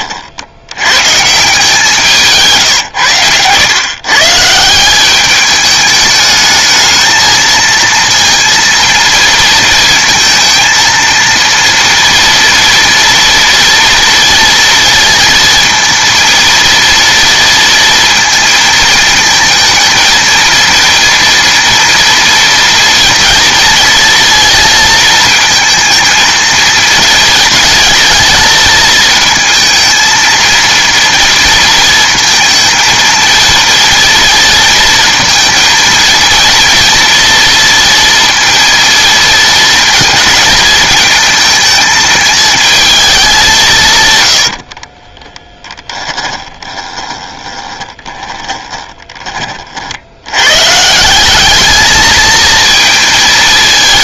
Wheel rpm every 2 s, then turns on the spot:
100, 140, 170, 220, 230, 230, 230, 230, 230, 220, 230, 230, 230, 230, 220, 230, 230, 220, 230, 230, 220, 220, 40, 20, 20, 140, 220.
44-50